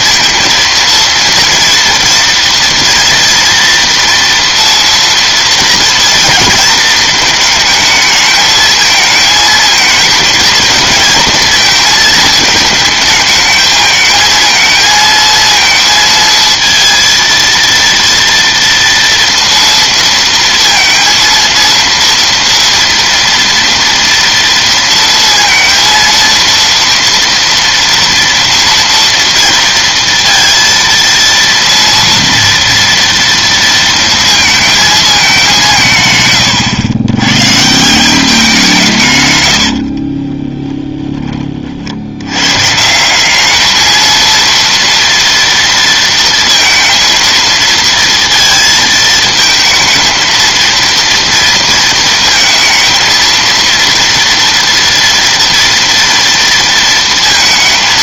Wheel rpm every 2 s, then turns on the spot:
230, 230, 240, 230, 220, 230, 220, 220, 230, 230, 230, 230, 230, 230, 230, 230, 230, 220, 100, 180, 20, 130, 230, 230, 230, 230, 230, 230, 230.
40-42